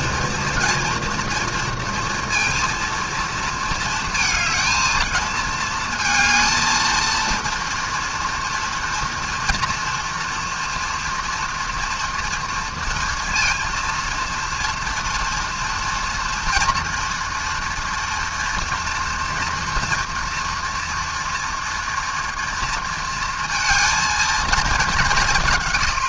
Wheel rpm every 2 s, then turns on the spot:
230, 230, 220, 220, 230, 240, 230, 230, 240, 230, 230, 230, 220.
none